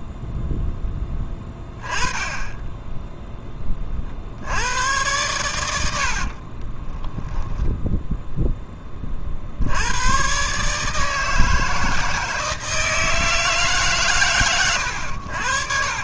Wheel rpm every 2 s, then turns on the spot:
0, 20, 70, 40, 10, 140, 160, 110.
6-8